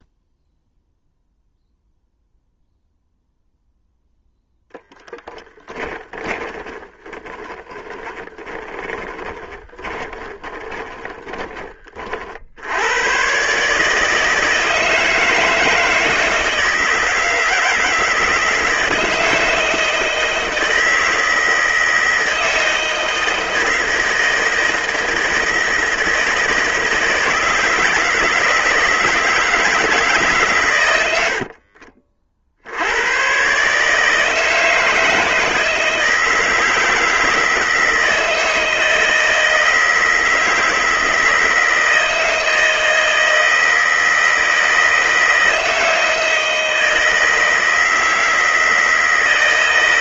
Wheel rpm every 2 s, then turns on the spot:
0, 0, 10, 20, 20, 20, 110, 160, 160, 160, 160, 160, 160, 160, 160, 100, 100, 160, 160, 160, 160, 160, 160, 160, 160.
4-12 30-32